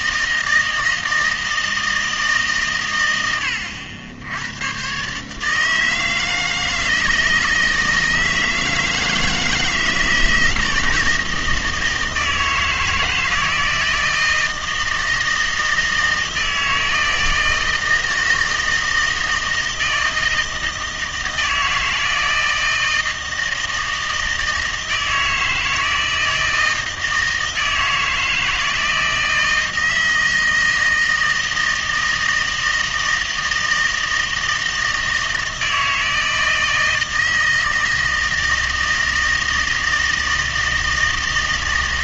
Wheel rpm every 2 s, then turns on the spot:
160, 140, 100, 160, 160, 160, 160, 160, 160, 160, 160, 160, 160, 160, 160, 160, 160, 160, 160, 160, 160.
none